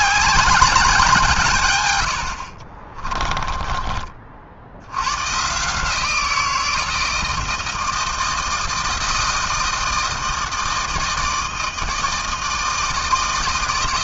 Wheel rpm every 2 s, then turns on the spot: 200, 60, 70, 170, 160, 160, 160.
2-4